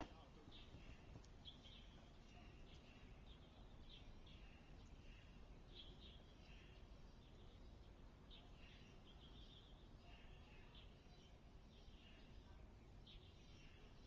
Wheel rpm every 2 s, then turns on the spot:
0, 0, 0, 0, 0, 0, 0.
none